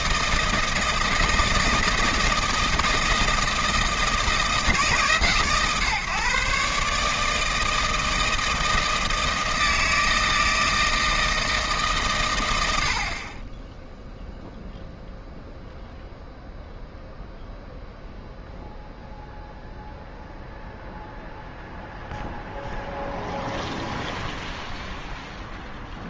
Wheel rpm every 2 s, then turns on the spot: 160, 160, 150, 140, 160, 160, 80, 0, 0, 0, 0, 0, 0.
none